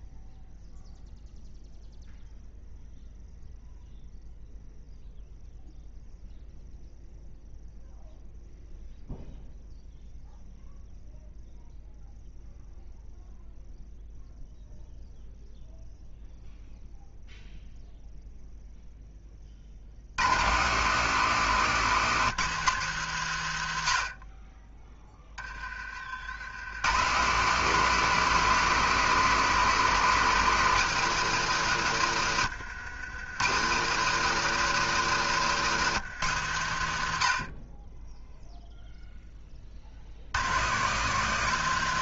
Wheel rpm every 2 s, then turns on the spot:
0, 0, 0, 0, 0, 0, 0, 0, 0, 0, 160, 160, 20, 110, 210, 210, 120, 200, 130, 0, 150.
none